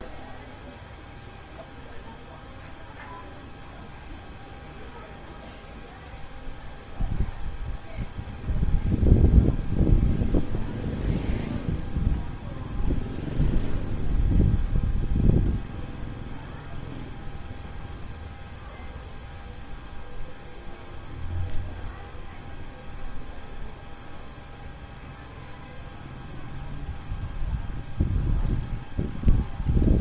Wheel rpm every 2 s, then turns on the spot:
0, 0, 0, 0, 0, 0, 0, 0, 0, 0, 0, 0, 0, 0, 0.
none